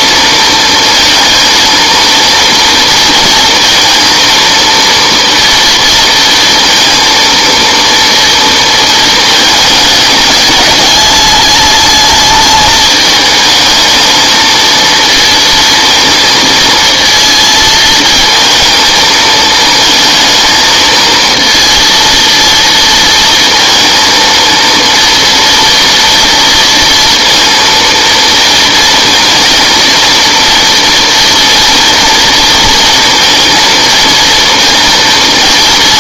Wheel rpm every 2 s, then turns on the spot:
230, 230, 230, 230, 230, 210, 210, 220, 230, 230, 220, 230, 230, 230, 230, 230, 230, 230.
none